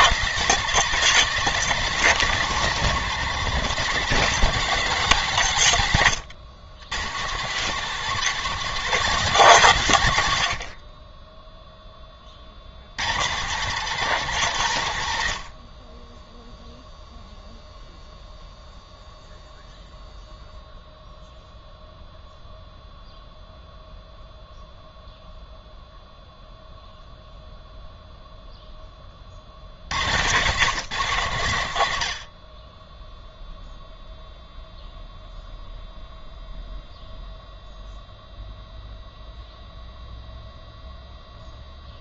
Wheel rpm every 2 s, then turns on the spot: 200, 190, 180, 120, 190, 50, 110, 110, 0, 0, 0, 0, 0, 0, 10, 150, 10, 0, 0, 0, 0.
none